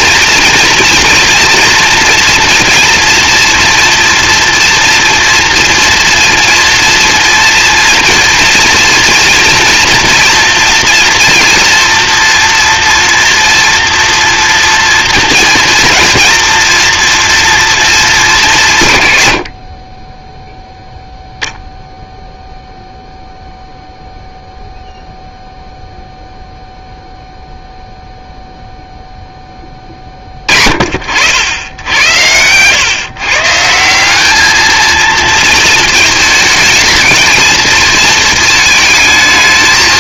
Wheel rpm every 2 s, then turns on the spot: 230, 230, 230, 240, 230, 240, 240, 240, 220, 220, 20, 0, 0, 0, 0, 40, 110, 220, 220, 220.
none